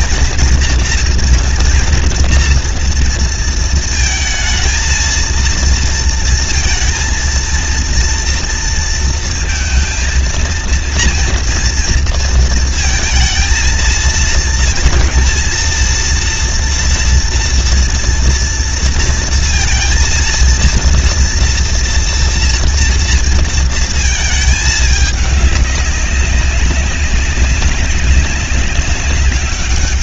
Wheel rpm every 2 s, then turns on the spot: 240, 230, 220, 230, 230, 230, 230, 220, 230, 230, 230, 230, 220, 200, 200.
none